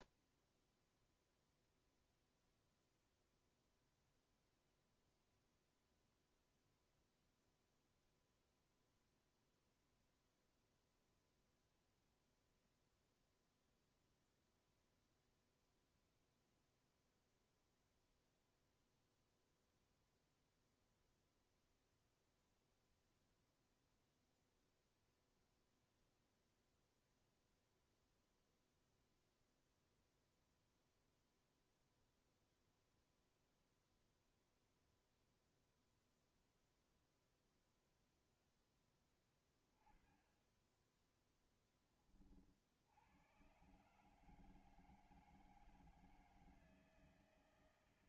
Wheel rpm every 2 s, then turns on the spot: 0, 0, 0, 0, 0, 0, 0, 0, 0, 0, 0, 0, 0, 0, 0, 0, 0, 0, 0, 10, 10, 60, 160, 160.
none